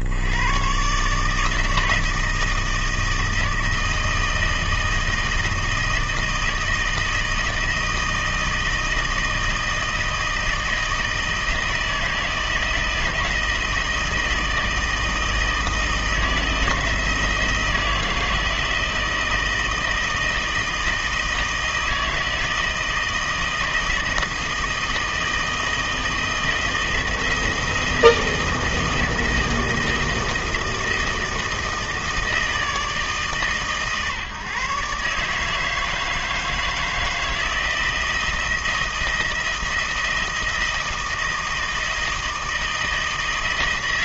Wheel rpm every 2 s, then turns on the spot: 80, 160, 160, 160, 160, 160, 160, 160, 170, 160, 160, 160, 160, 160, 160, 160, 160, 140, 160, 160, 160, 160.
none